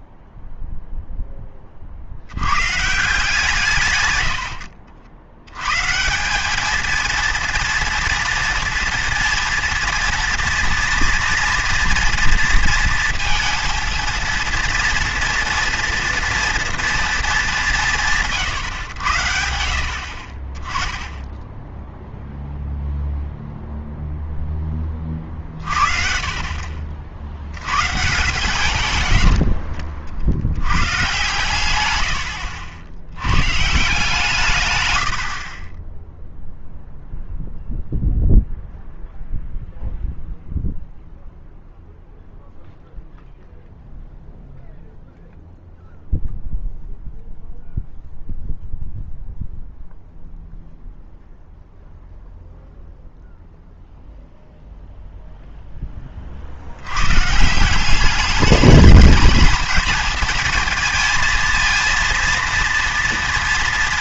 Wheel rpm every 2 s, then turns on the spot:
0, 130, 70, 220, 230, 240, 230, 240, 230, 130, 20, 0, 20, 50, 120, 100, 70, 120, 0, 0, 0, 0, 0, 0, 0, 0, 0, 0, 90, 210, 230, 230.
none